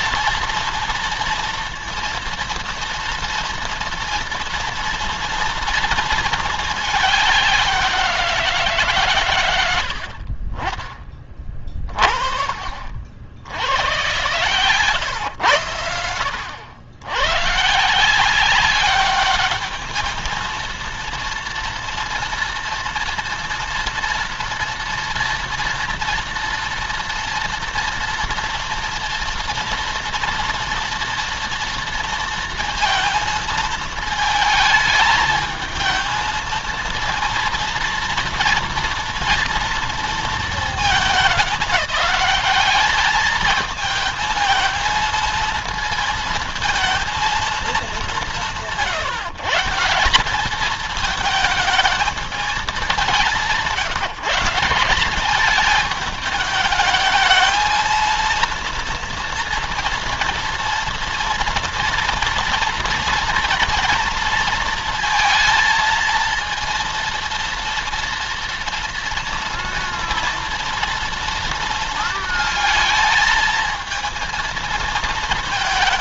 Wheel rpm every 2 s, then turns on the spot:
230, 230, 230, 220, 160, 30, 40, 120, 80, 190, 220, 230, 240, 230, 230, 230, 230, 220, 230, 230, 220, 210, 230, 220, 180, 210, 210, 180, 220, 230, 240, 230, 230, 230, 240, 230, 220, 220.
none